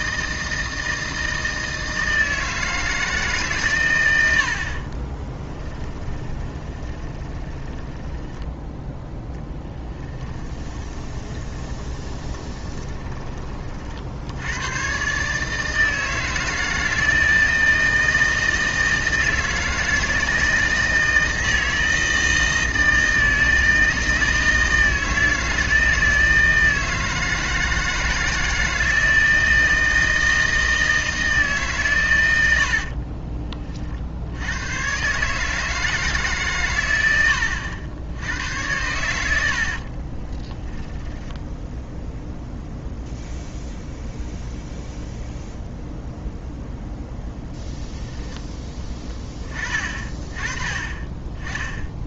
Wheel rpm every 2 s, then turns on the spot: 160, 160, 40, 20, 10, 30, 20, 110, 160, 160, 160, 160, 160, 160, 160, 160, 70, 110, 110, 100, 10, 0, 0, 10, 20, 30.
4-8 10-14 32-34 40-42